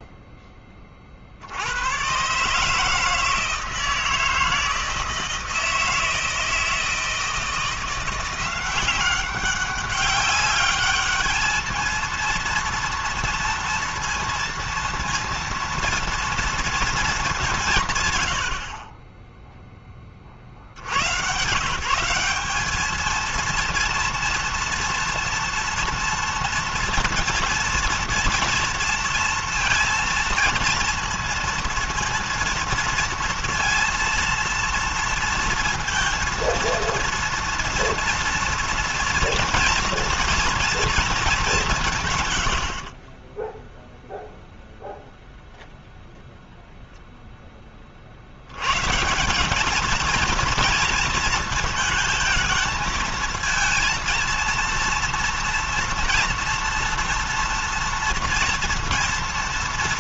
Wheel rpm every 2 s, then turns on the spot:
30, 150, 160, 160, 190, 210, 230, 230, 230, 40, 90, 210, 230, 230, 230, 230, 230, 230, 230, 230, 230, 50, 0, 0, 130, 230, 220, 230, 240, 230.
none